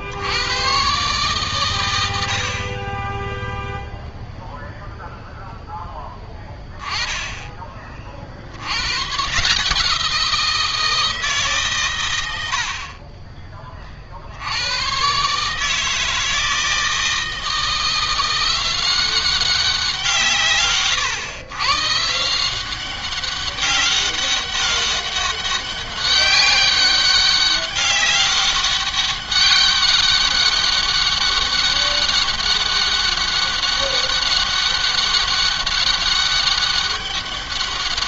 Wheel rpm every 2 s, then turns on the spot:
120, 20, 0, 10, 100, 170, 40, 110, 160, 180, 130, 180, 200, 200, 190, 200, 200, 200, 200.
none